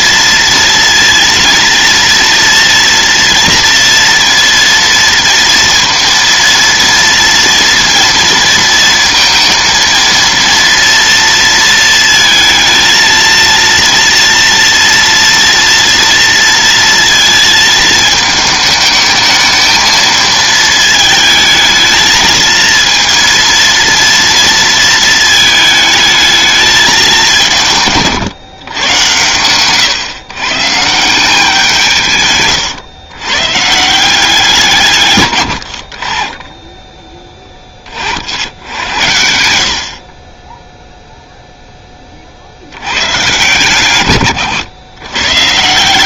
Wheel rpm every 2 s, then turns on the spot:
230, 230, 230, 230, 230, 230, 230, 230, 230, 220, 220, 230, 220, 180, 110, 160, 110, 130, 20, 90, 0, 120, 120.
none